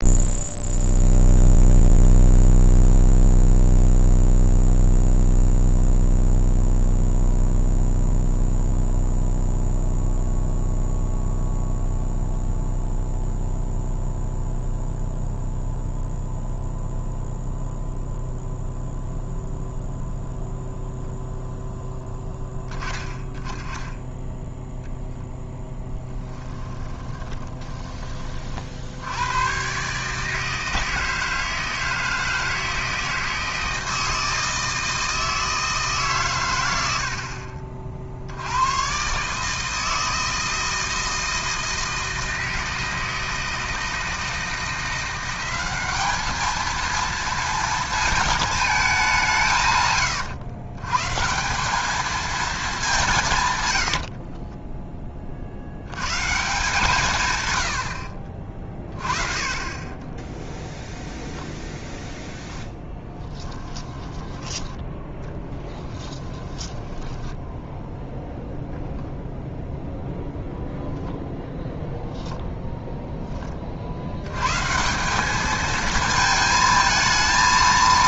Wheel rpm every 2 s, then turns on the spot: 0, 0, 0, 0, 0, 0, 0, 0, 0, 0, 0, 10, 10, 10, 40, 150, 160, 160, 110, 90, 160, 160, 160, 220, 220, 120, 210, 20, 140, 30, 10, 0, 10, 10, 0, 0, 0, 120, 220.
26-28 54-56 60-62 64-68